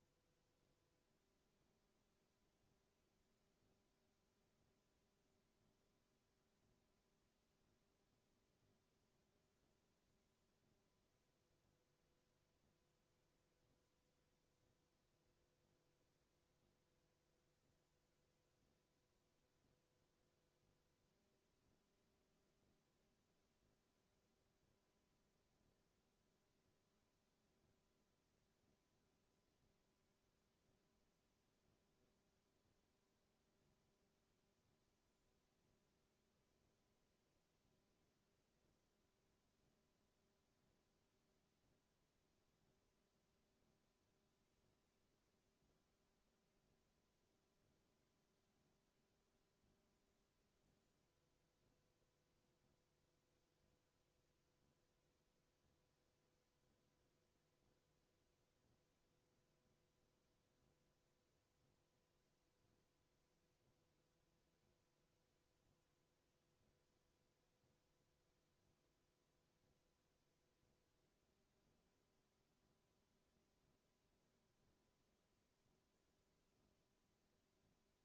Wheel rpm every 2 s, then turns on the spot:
0, 0, 0, 0, 0, 0, 0, 0, 0, 0, 0, 0, 0, 0, 0, 0, 0, 0, 0, 0, 0, 0, 0, 0, 0, 0, 0, 0, 0, 0, 0, 0, 0, 0, 0, 0, 0, 0, 0.
none